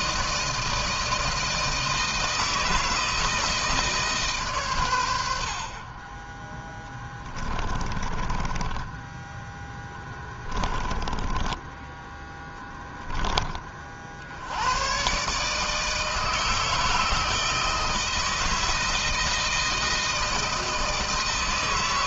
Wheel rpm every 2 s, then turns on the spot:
160, 160, 130, 20, 20, 10, 10, 80, 160, 160, 160.
8-12